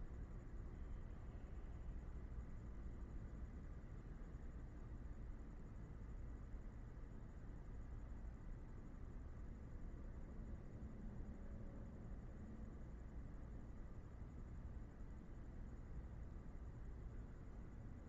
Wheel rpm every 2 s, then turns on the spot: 0, 0, 0, 0, 0, 0, 0, 0, 0.
none